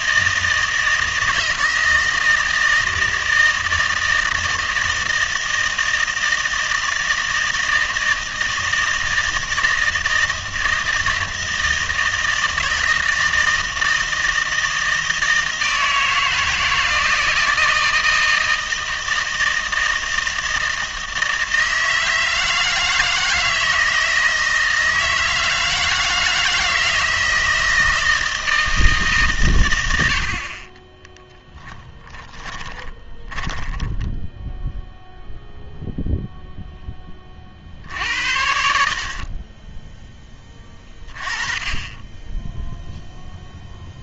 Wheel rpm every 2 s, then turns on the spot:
160, 160, 160, 160, 160, 160, 160, 160, 160, 160, 160, 160, 160, 160, 160, 30, 20, 0, 0, 60, 20, 0.
30-34